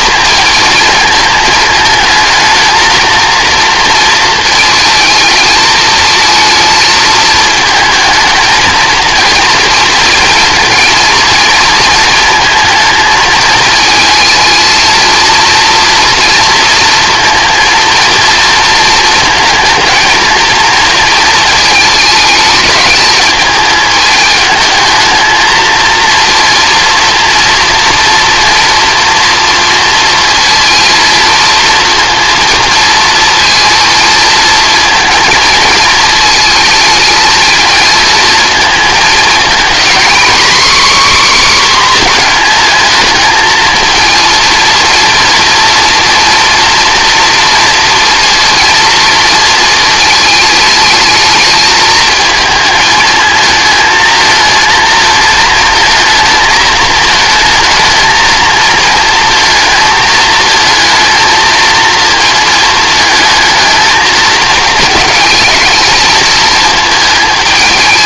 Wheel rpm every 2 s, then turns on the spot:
220, 230, 230, 220, 230, 230, 220, 230, 230, 220, 230, 210, 220, 230, 240, 230, 230, 230, 220, 220, 270, 220, 240, 230, 230, 210, 220, 220, 220, 230, 220, 220, 220, 220.
none